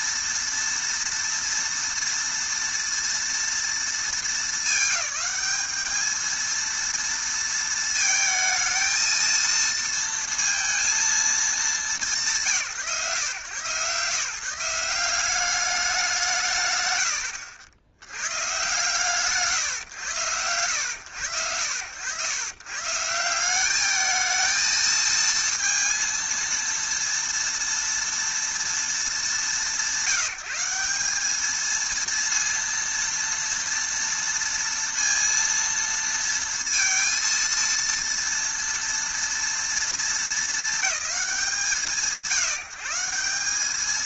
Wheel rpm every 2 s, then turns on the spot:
230, 230, 210, 230, 220, 220, 110, 170, 70, 140, 90, 150, 220, 230, 220, 190, 230, 230, 230, 230, 180, 140.
none